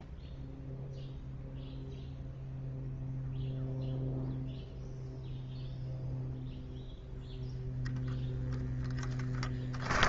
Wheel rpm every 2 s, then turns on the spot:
0, 0, 0, 0, 10.
8-10